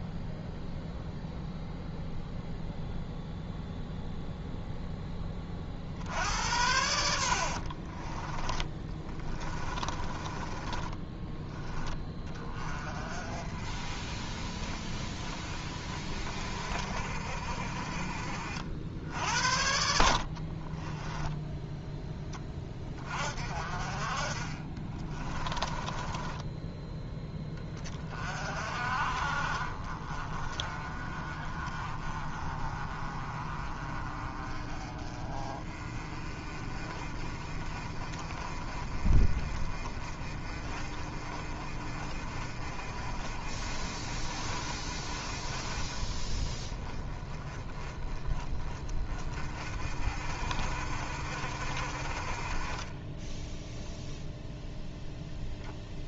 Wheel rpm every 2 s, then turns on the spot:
0, 0, 0, 80, 20, 20, 30, 30, 40, 60, 20, 30, 20, 10, 50, 30, 30, 30, 30, 30, 30, 30, 30, 20, 20, 40, 20, 0.
8-12 20-22 24-26